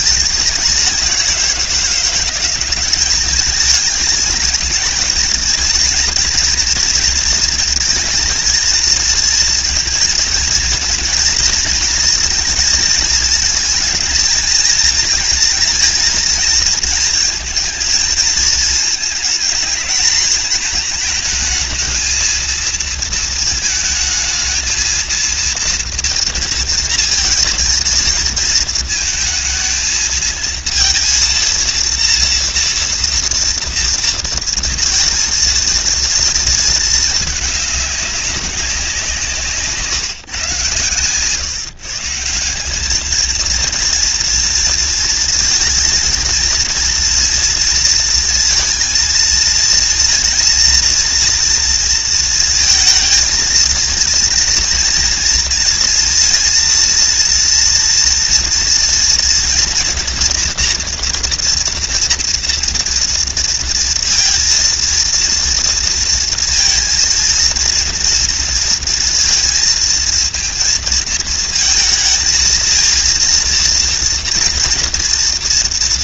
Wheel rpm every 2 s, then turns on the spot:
190, 200, 220, 230, 220, 230, 220, 230, 220, 220, 220, 220, 230, 230, 220, 230, 230, 230, 210, 170, 130, 220, 230, 230, 230, 230, 220, 230, 230, 230, 230, 230, 230, 230, 230, 230, 230, 240.
none